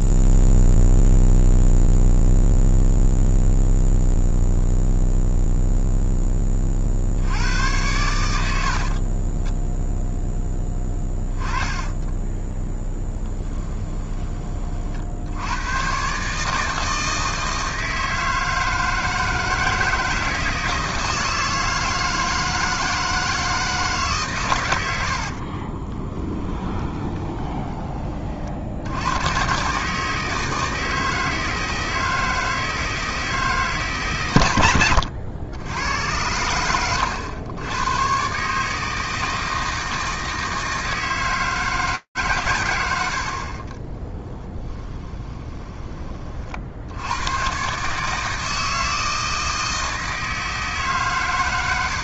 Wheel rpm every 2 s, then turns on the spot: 0, 0, 0, 30, 80, 10, 10, 20, 150, 160, 170, 160, 110, 20, 60, 160, 160, 120, 90, 150, 160, 80, 10, 60, 160, 150.
8-14 26-28 44-46